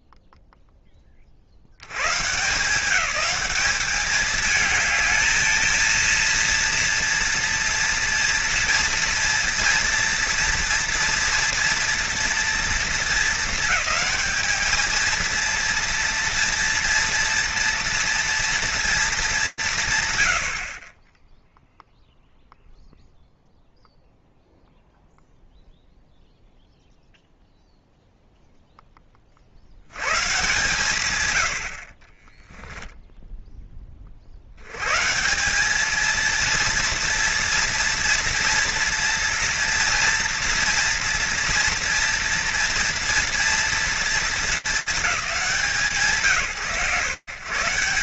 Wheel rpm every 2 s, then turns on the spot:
20, 190, 220, 230, 230, 230, 220, 220, 230, 210, 10, 0, 0, 0, 20, 120, 10, 130, 230, 230, 230, 230, 220, 130.
32-34